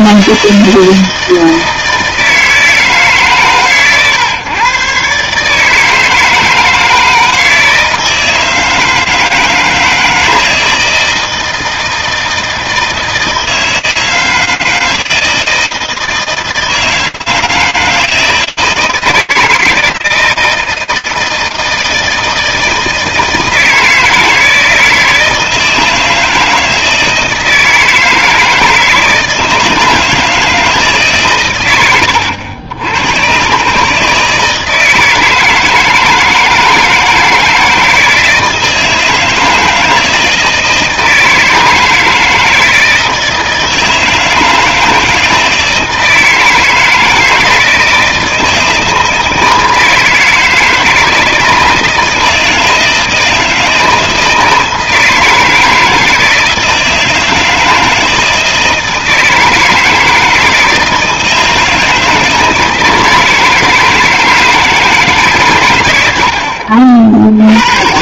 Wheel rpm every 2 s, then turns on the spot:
160, 160, 130, 160, 160, 160, 160, 160, 160, 160, 160, 160, 160, 160, 160, 160, 90, 150, 160, 160, 160, 160, 160, 160, 160, 160, 160, 160, 160, 160, 160, 160, 160, 40.
none